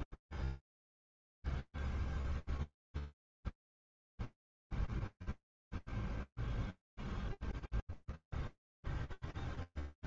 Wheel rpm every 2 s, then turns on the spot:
0, 0, 40, 20, 0.
none